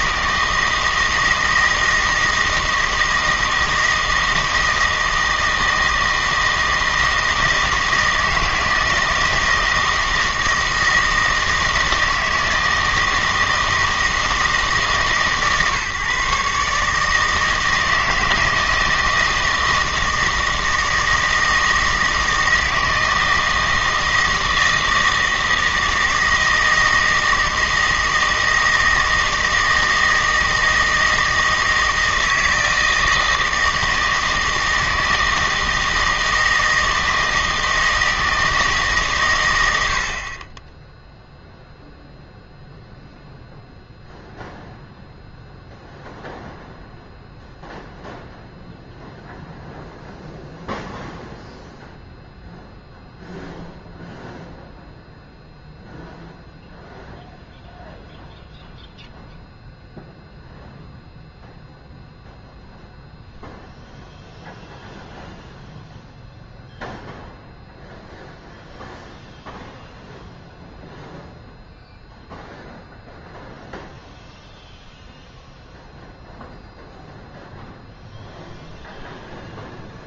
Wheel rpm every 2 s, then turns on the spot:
160, 160, 160, 160, 160, 160, 160, 160, 140, 160, 160, 160, 160, 160, 160, 160, 160, 160, 160, 160, 10, 0, 0, 0, 0, 0, 0, 0, 0, 0, 0, 0, 0, 0, 0, 0, 0, 0, 0, 0.
none